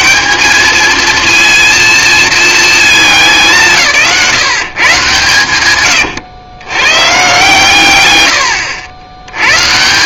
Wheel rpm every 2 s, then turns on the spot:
210, 220, 170, 110, 100.
8-10